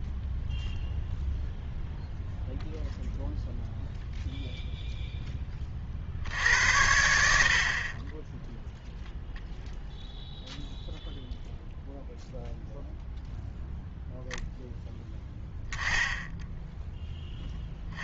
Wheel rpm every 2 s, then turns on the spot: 0, 0, 0, 90, 10, 0, 0, 0, 0.
none